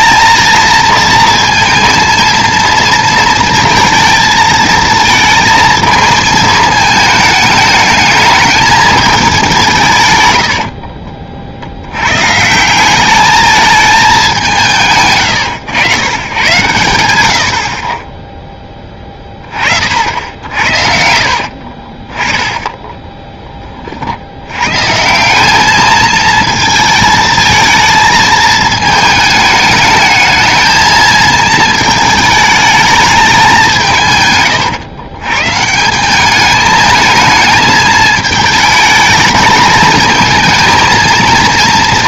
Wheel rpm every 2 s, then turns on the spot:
230, 230, 230, 220, 220, 70, 170, 160, 120, 10, 70, 10, 130, 220, 220, 220, 210, 120, 220, 220, 220.
10-12